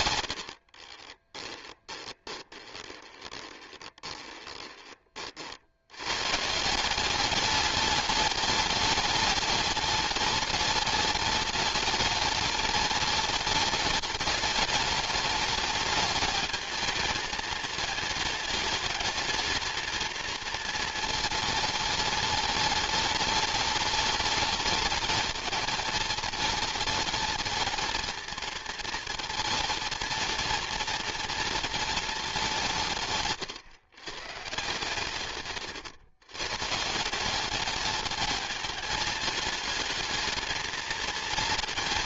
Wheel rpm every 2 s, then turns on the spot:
40, 20, 20, 170, 210, 210, 210, 210, 220, 220, 230, 210, 210, 220, 230, 230, 170, 140, 150, 210, 230.
0-4